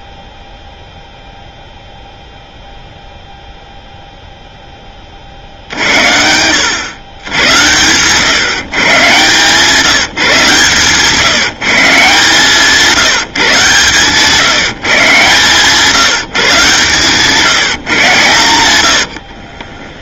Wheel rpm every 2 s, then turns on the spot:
0, 0, 10, 110, 140, 150, 160, 160, 140, 90.
18-20